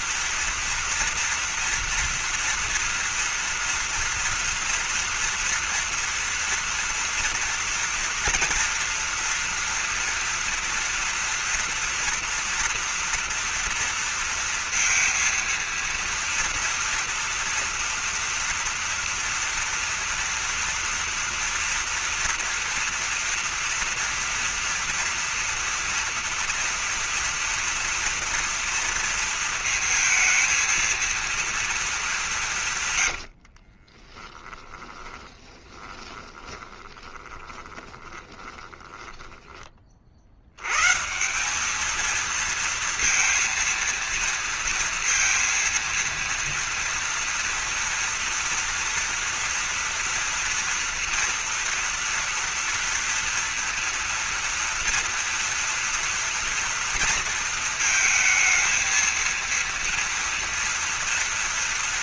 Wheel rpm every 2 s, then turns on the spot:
230, 230, 230, 230, 230, 230, 230, 230, 230, 230, 240, 230, 230, 230, 230, 230, 160, 20, 20, 20, 100, 230, 230, 230, 230, 230, 230, 230, 230, 220, 230.
34-40